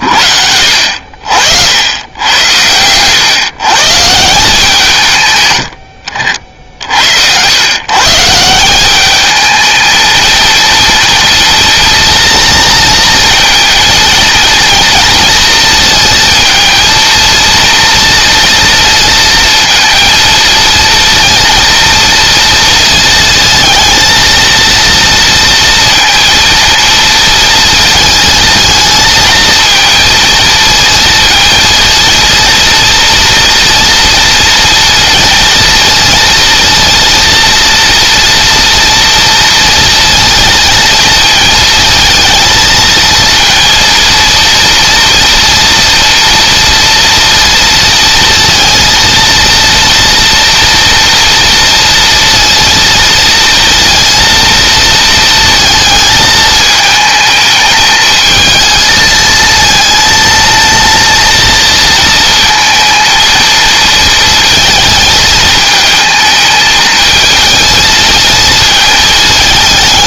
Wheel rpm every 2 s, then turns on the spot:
70, 100, 160, 60, 180, 230, 230, 230, 230, 230, 230, 230, 230, 230, 230, 220, 230, 230, 230, 230, 230, 220, 230, 230, 230, 240, 230, 230, 220, 220, 230, 230, 220, 220, 220.
none